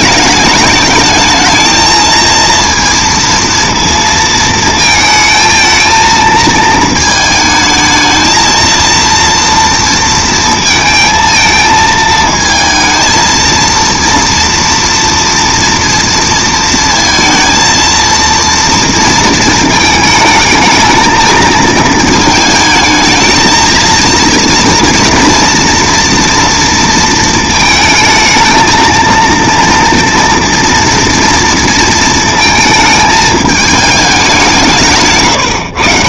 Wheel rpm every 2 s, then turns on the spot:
210, 230, 220, 220, 230, 230, 220, 230, 230, 230, 220, 220, 230, 230, 220, 240, 220, 170.
none